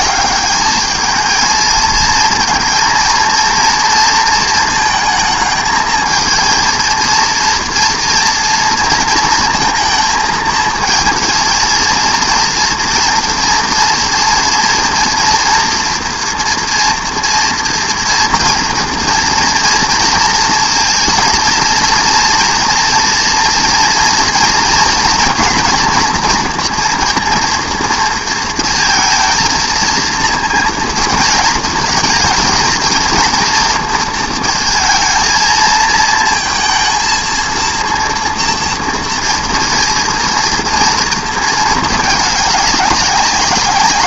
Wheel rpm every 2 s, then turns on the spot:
210, 230, 220, 230, 230, 220, 230, 230, 240, 230, 230, 230, 230, 230, 230, 230, 230, 230, 230, 230, 230, 200.
none